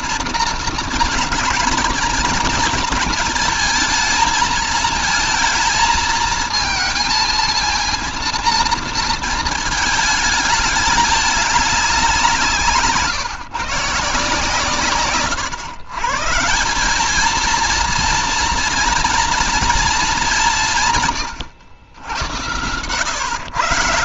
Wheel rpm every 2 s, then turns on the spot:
230, 230, 220, 220, 230, 220, 170, 150, 160, 230, 190, 90.
none